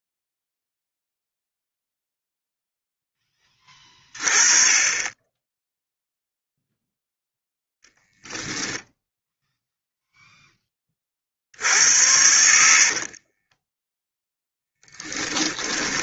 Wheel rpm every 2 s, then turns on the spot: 0, 10, 40, 0, 0, 20, 70, 10.
12-16